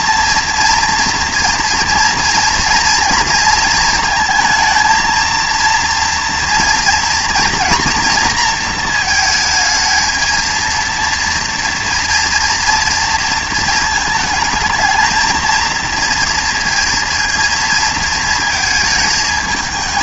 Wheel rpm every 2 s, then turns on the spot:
230, 230, 220, 230, 230, 230, 230, 220, 230, 220.
none